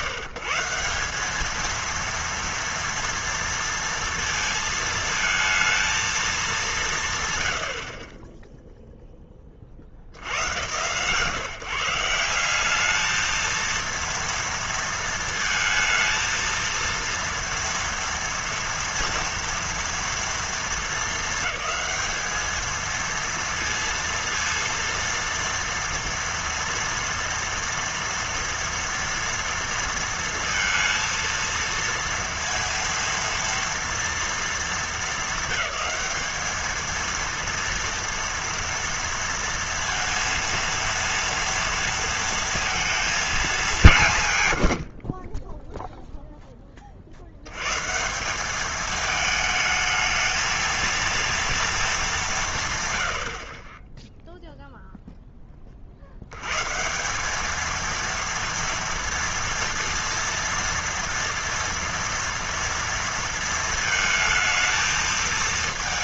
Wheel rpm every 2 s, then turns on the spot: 150, 230, 230, 190, 10, 100, 190, 230, 230, 230, 220, 220, 230, 230, 230, 230, 230, 230, 220, 230, 230, 230, 120, 10, 200, 220, 160, 0, 100, 230, 230, 230, 220.
none